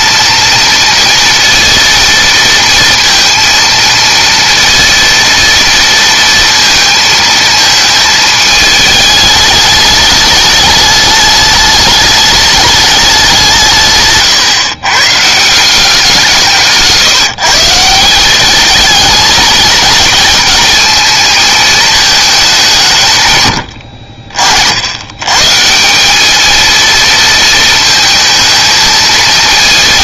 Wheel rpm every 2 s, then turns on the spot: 230, 230, 230, 230, 210, 210, 210, 140, 160, 210, 220, 180, 60, 220, 220.
none